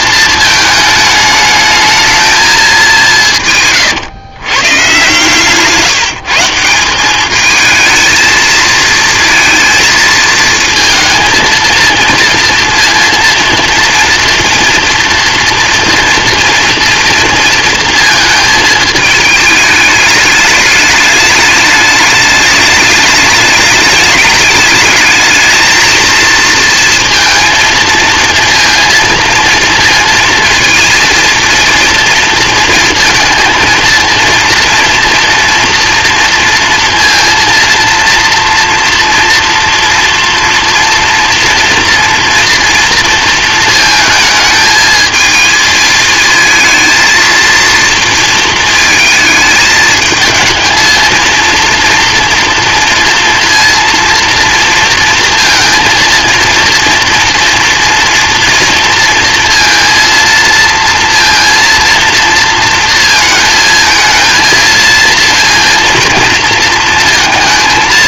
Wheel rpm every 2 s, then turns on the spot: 220, 210, 120, 180, 220, 220, 230, 230, 230, 220, 210, 210, 210, 230, 230, 230, 230, 230, 230, 230, 230, 230, 220, 230, 230, 220, 230, 230, 230, 230, 230, 230, 230, 230.
none